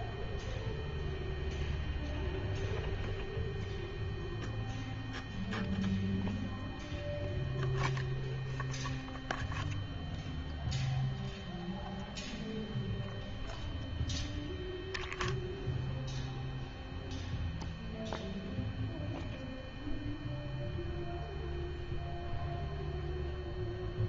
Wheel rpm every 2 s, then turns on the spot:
0, 0, 0, 0, 0, 0, 0, 0, 0, 0, 0, 0.
none